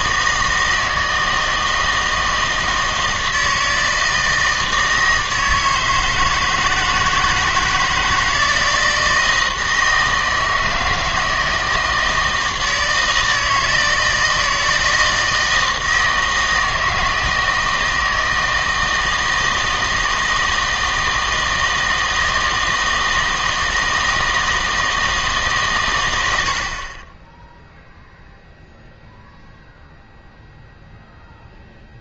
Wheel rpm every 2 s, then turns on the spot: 160, 160, 160, 160, 160, 160, 160, 160, 160, 160, 160, 160, 160, 60, 0, 0.
none